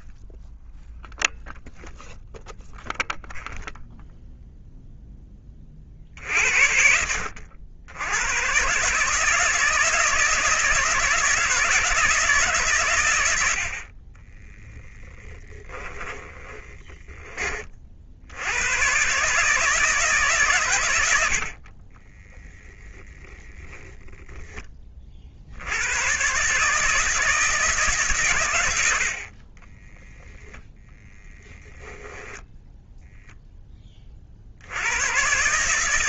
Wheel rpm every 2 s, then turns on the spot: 0, 0, 0, 80, 150, 160, 110, 0, 20, 120, 100, 0, 30, 160, 80, 10, 0, 100.
none